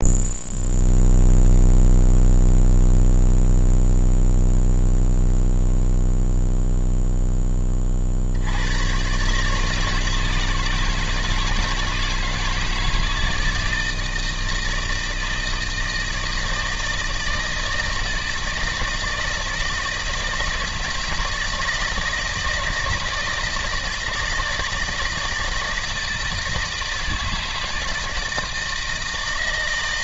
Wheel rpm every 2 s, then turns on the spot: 0, 0, 0, 0, 100, 160, 160, 160, 160, 160, 160, 160, 160, 160, 160.
none